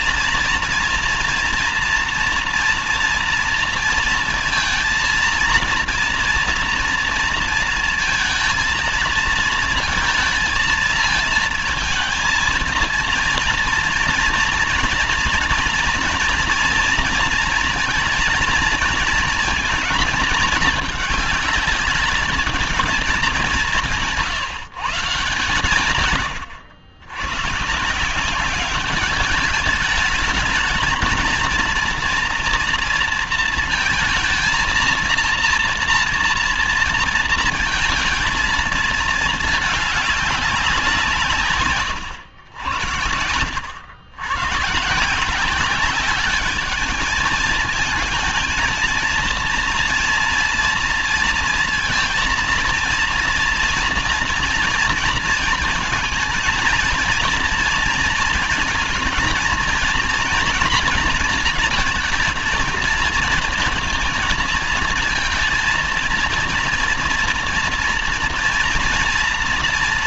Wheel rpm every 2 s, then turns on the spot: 230, 230, 230, 230, 220, 220, 230, 230, 230, 230, 220, 220, 150, 110, 200, 220, 230, 230, 230, 230, 190, 100, 130, 210, 220, 230, 230, 240, 230, 230, 230, 220, 230, 230, 230.
none